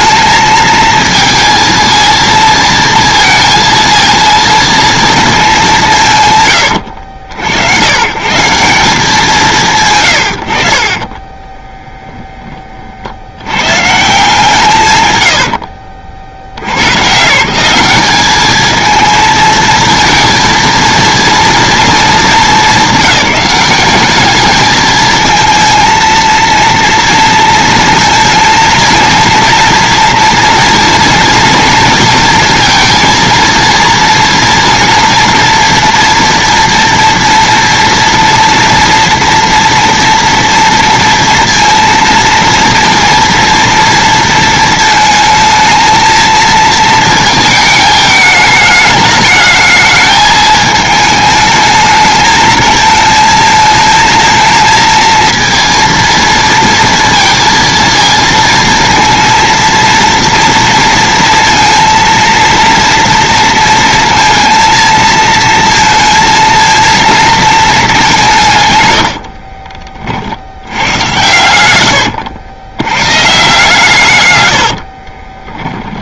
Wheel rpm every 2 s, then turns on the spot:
230, 230, 230, 110, 180, 70, 30, 160, 80, 210, 230, 220, 210, 230, 220, 230, 230, 230, 230, 230, 230, 230, 230, 230, 210, 220, 220, 230, 230, 230, 230, 230, 230, 230, 140, 80, 90, 90.
74-76